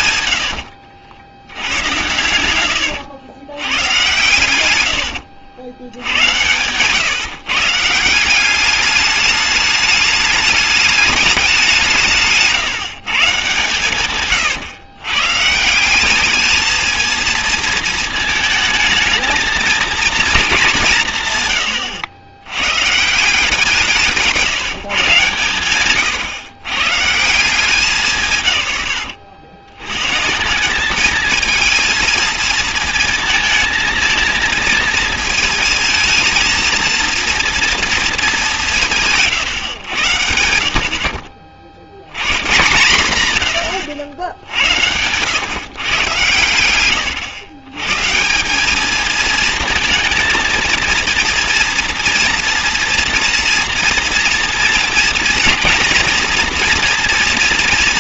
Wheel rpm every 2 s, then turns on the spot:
70, 90, 100, 120, 200, 210, 150, 130, 220, 220, 190, 120, 160, 130, 110, 200, 230, 230, 230, 170, 70, 130, 80, 110, 200, 230, 240, 230, 230.
0-2 4-6